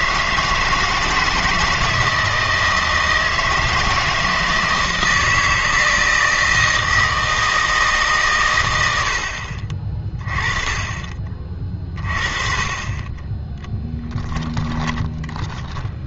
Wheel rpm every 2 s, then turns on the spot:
160, 160, 160, 160, 110, 30, 30, 10.
14-16